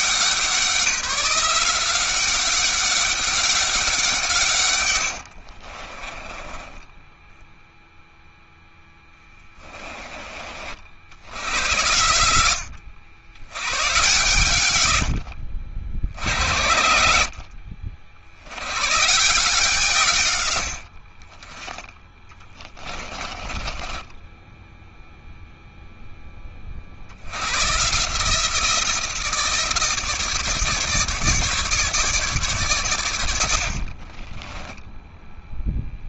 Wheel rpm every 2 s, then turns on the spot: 180, 200, 90, 10, 10, 80, 90, 100, 80, 140, 50, 20, 0, 70, 170, 150, 100, 0.
4-8 14-16 22-24